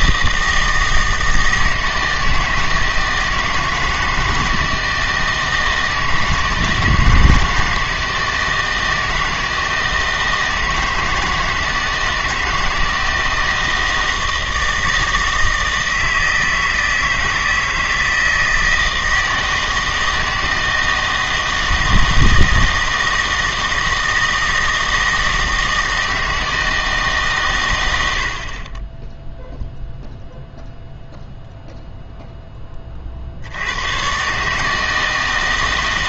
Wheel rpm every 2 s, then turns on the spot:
160, 160, 160, 160, 160, 160, 160, 160, 160, 160, 160, 160, 160, 160, 20, 0, 20, 150.
none